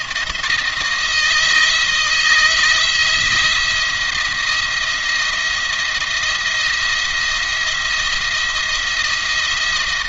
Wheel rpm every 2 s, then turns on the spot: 160, 170, 170, 170, 170.
none